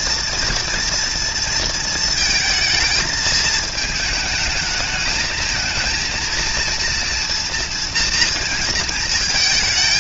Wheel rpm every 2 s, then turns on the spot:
230, 220, 220, 230, 230.
none